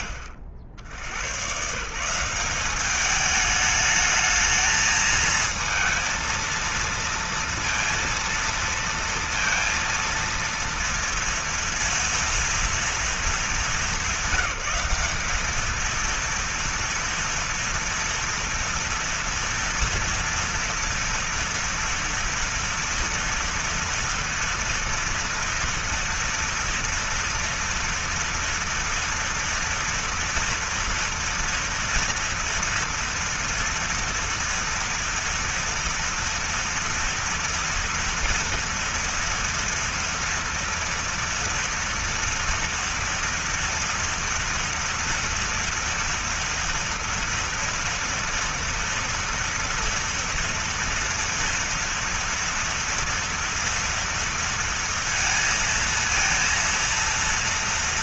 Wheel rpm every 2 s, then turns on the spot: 80, 200, 220, 230, 230, 230, 230, 200, 230, 230, 230, 240, 230, 230, 230, 230, 230, 230, 230, 230, 230, 230, 240, 230, 230, 230, 230, 230, 230.
none